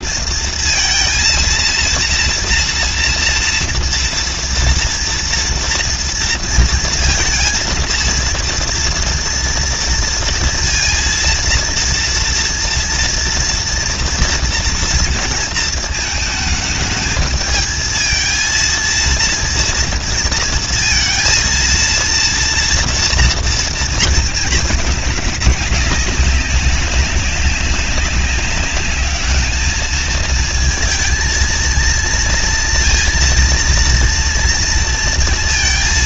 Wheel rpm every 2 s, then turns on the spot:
230, 230, 230, 230, 230, 230, 230, 230, 220, 220, 230, 230, 220, 190, 200, 220, 230, 230.
none